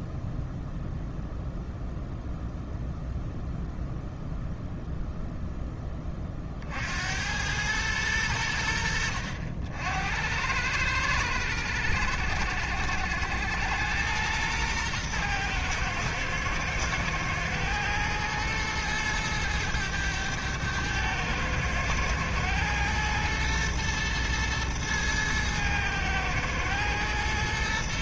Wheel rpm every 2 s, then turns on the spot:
0, 0, 0, 40, 90, 90, 70, 110, 110, 110, 110, 110, 110, 110.
none